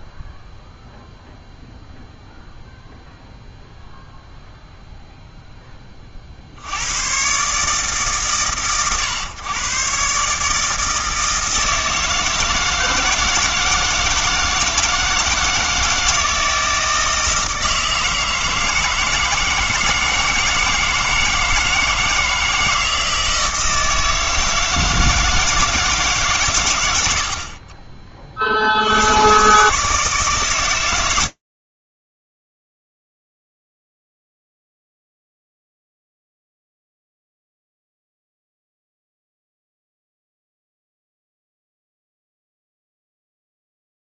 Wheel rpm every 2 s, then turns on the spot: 0, 0, 0, 80, 130, 160, 160, 160, 160, 160, 160, 160, 160, 120, 70, 110, 10, 0, 10, 10, 0, 20.
42-44